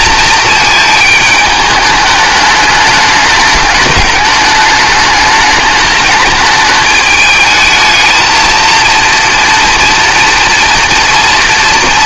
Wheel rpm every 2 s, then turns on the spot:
220, 210, 210, 220, 230, 230.
none